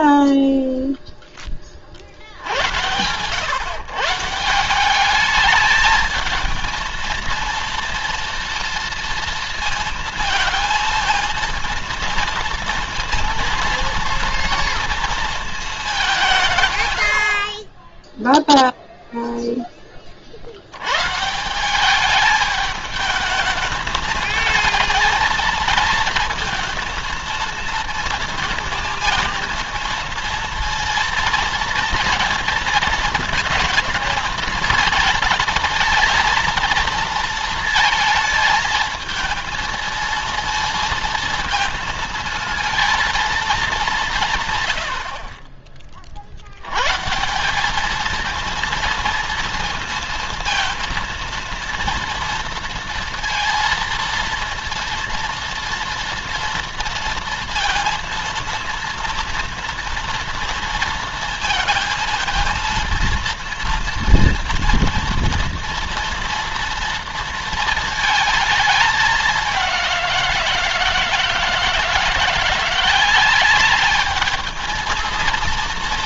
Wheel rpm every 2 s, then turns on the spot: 0, 80, 180, 230, 230, 230, 230, 230, 140, 0, 70, 210, 220, 230, 220, 220, 230, 220, 230, 220, 230, 220, 130, 90, 230, 230, 230, 230, 240, 230, 230, 230, 230, 230, 220, 170, 170, 220.
none